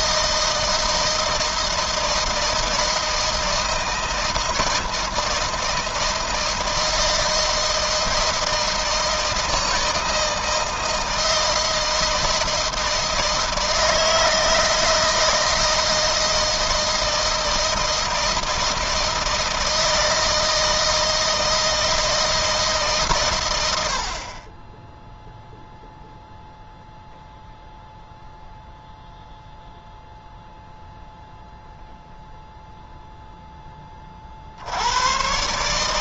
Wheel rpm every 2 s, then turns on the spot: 160, 160, 160, 160, 160, 160, 160, 160, 160, 160, 160, 130, 10, 0, 0, 0, 0, 110.
none